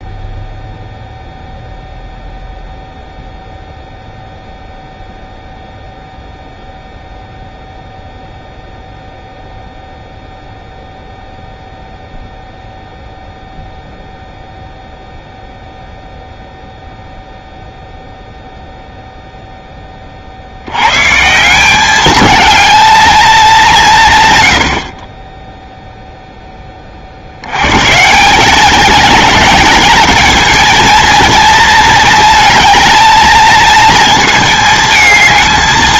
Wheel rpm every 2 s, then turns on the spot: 0, 0, 0, 0, 0, 0, 0, 0, 0, 0, 80, 220, 70, 20, 210, 230, 220, 220.
none